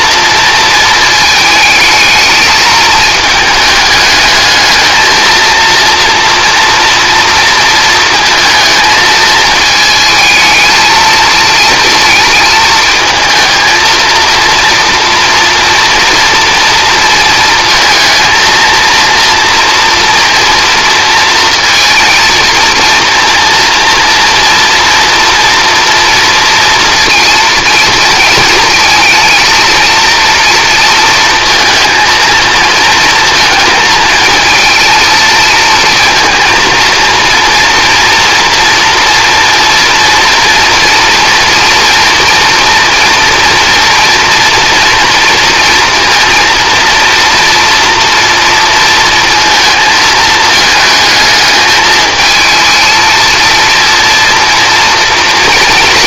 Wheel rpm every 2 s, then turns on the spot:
230, 220, 220, 230, 220, 220, 220, 230, 230, 230, 230, 230, 230, 230, 230, 230, 220, 230, 230, 230, 230, 240, 230, 230, 230, 220, 220, 230.
none